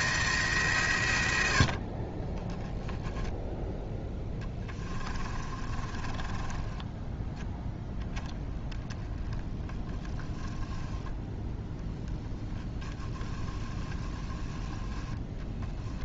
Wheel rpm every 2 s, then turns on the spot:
140, 10, 20, 10, 10, 10, 10, 10.
4-8